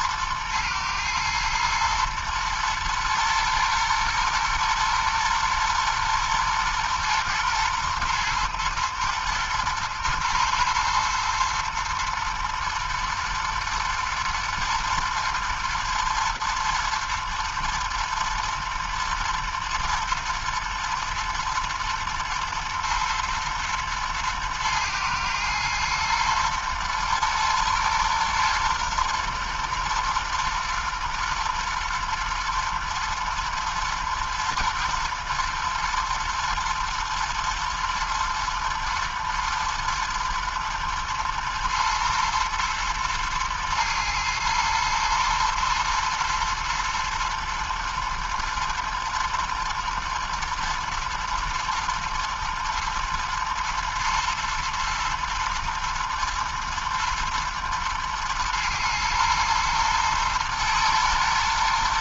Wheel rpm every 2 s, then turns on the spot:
110, 110, 120, 120, 120, 120, 110, 110, 110, 110, 110, 110, 110, 120, 120, 120, 120, 120, 120, 110, 110, 110, 110, 110, 110, 110, 110, 110, 110, 120, 120.
none